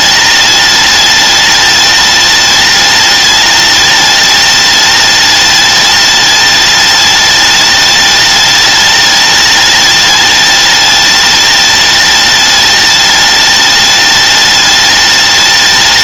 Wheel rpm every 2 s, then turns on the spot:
210, 210, 210, 210, 210, 210, 210, 210.
none